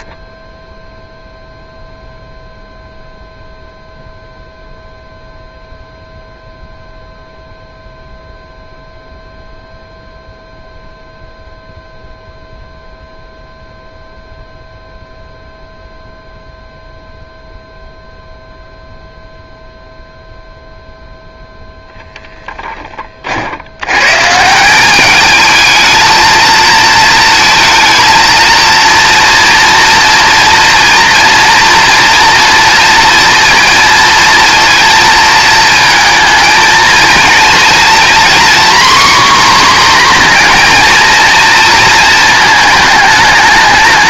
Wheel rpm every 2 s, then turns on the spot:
0, 0, 0, 0, 0, 0, 0, 0, 0, 0, 0, 10, 190, 230, 230, 230, 230, 230, 230, 260, 240, 220.
none